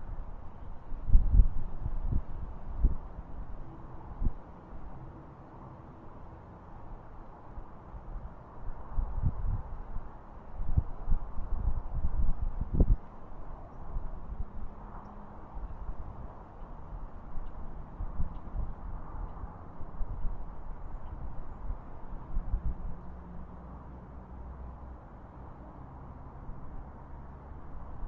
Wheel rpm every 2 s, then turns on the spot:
0, 0, 0, 0, 0, 0, 0, 0, 0, 0, 0, 0, 0, 0.
none